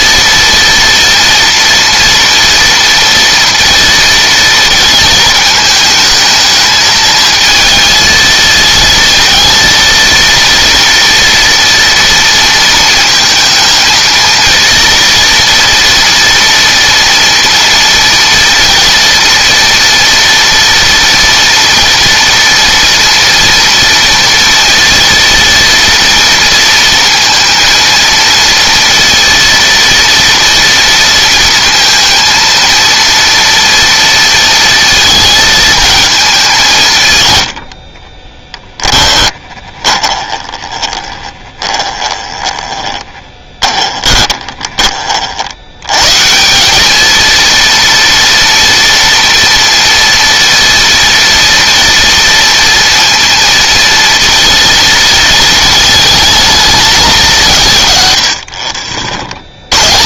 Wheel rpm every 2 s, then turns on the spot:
230, 230, 220, 220, 230, 230, 230, 230, 230, 240, 230, 240, 230, 230, 230, 230, 230, 230, 160, 10, 30, 20, 20, 200, 230, 230, 230, 220, 220, 60.
38-44